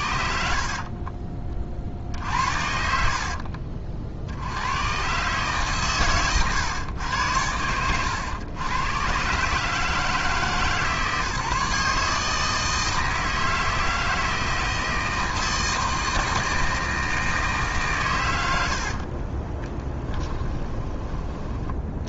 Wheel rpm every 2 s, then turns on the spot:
50, 60, 90, 120, 110, 150, 160, 160, 160, 70, 20.
0-4 20-22